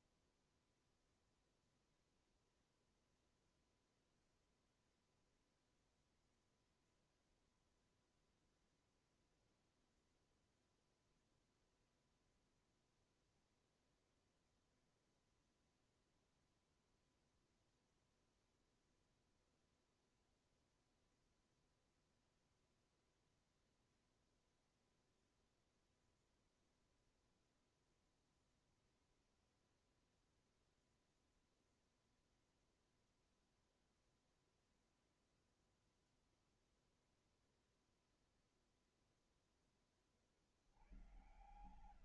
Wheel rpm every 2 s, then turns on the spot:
0, 0, 0, 0, 0, 0, 0, 0, 0, 0, 0, 0, 0, 0, 0, 0, 0, 0, 0, 0, 10.
none